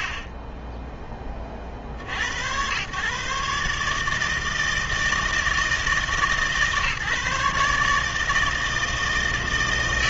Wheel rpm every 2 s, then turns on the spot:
30, 110, 160, 150, 160.
0-2